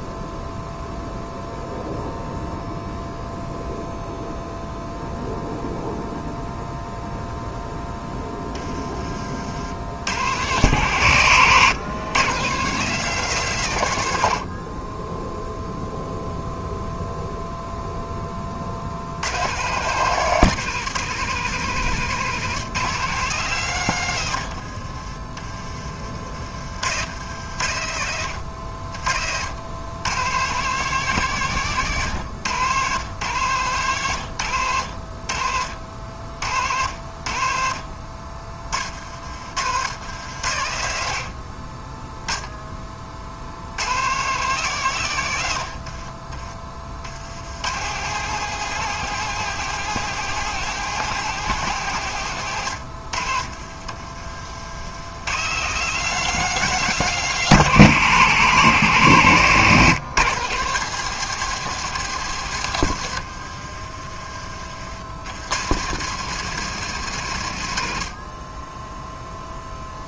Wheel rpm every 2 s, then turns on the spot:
0, 0, 0, 0, 40, 110, 150, 10, 0, 90, 160, 140, 40, 80, 60, 150, 120, 60, 60, 50, 50, 50, 110, 80, 170, 170, 70, 100, 150, 110, 160, 90, 80, 130, 0.
24-26 28-30 62-64